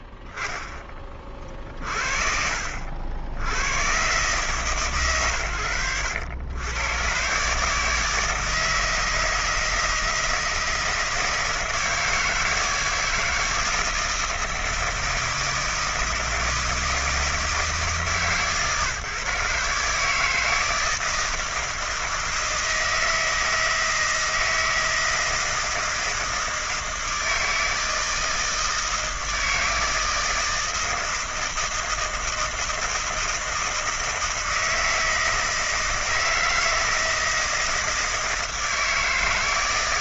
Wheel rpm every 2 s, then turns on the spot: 30, 80, 120, 130, 160, 160, 160, 160, 160, 150, 160, 160, 160, 160, 160, 160, 160, 160, 160, 160.
none